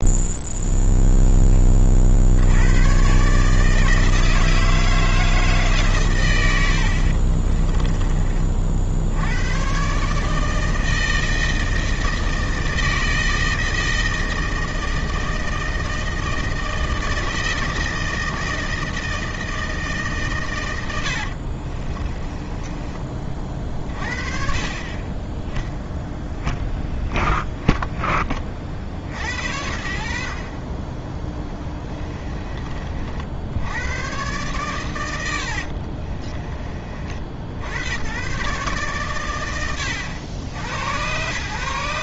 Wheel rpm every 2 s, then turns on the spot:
0, 120, 160, 70, 60, 160, 160, 160, 160, 160, 90, 20, 30, 10, 60, 20, 40, 110, 40, 130, 100.
none